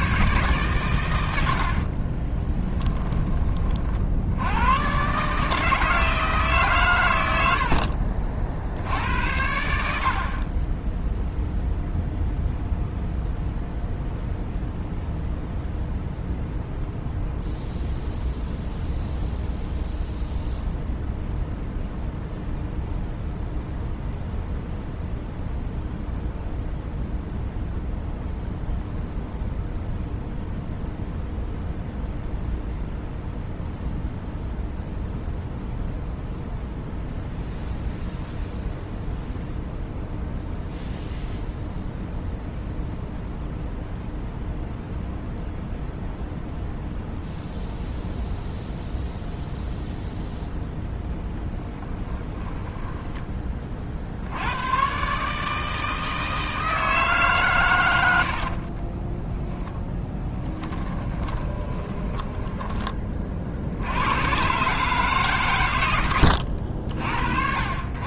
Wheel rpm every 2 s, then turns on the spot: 120, 10, 120, 120, 70, 10, 0, 0, 0, 0, 0, 0, 0, 0, 0, 0, 0, 0, 0, 0, 0, 0, 0, 0, 0, 0, 10, 120, 160, 40, 20, 20, 140, 60.
52-54 58-62